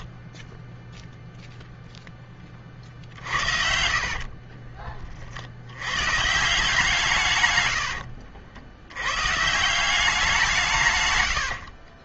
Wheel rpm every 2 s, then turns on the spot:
10, 30, 40, 160, 90, 160.
0-2 4-6